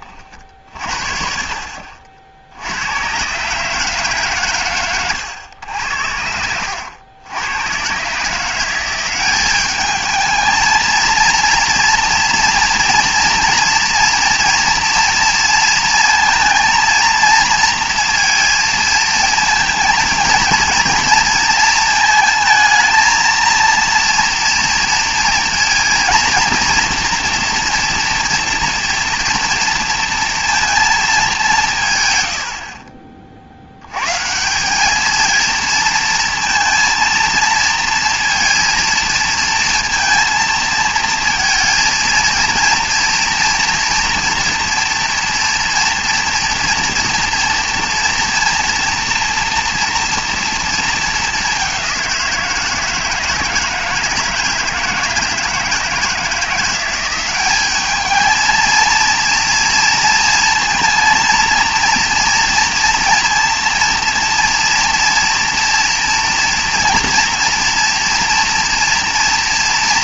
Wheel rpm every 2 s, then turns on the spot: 50, 80, 130, 80, 180, 220, 230, 240, 230, 230, 230, 220, 230, 230, 240, 230, 60, 190, 230, 230, 220, 230, 230, 230, 230, 230, 170, 160, 170, 220, 230, 230, 240, 230, 230.
none